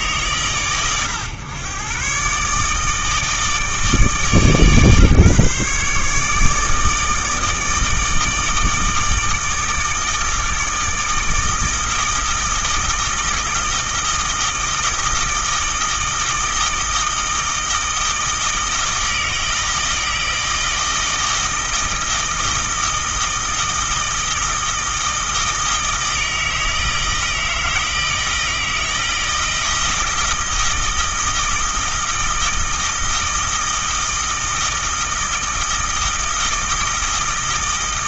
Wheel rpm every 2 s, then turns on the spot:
110, 150, 140, 160, 160, 160, 160, 160, 160, 160, 160, 160, 160, 160, 160, 160, 160, 160, 160.
none